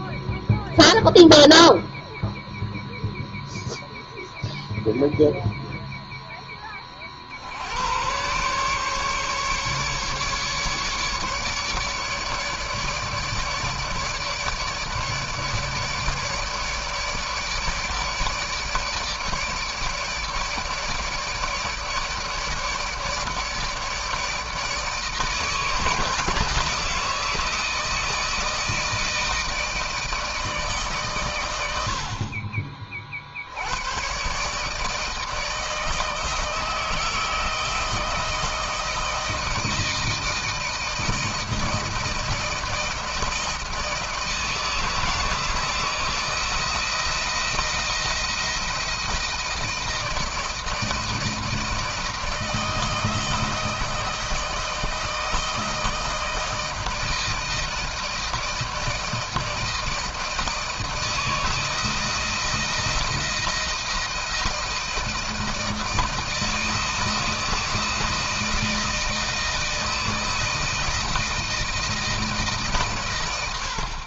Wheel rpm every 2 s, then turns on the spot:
0, 0, 0, 20, 130, 150, 150, 150, 150, 160, 150, 150, 160, 160, 160, 150, 40, 140, 160, 160, 160, 160, 160, 160, 170, 160, 160, 160, 160, 160, 160, 160, 160, 160, 160, 160, 140.
none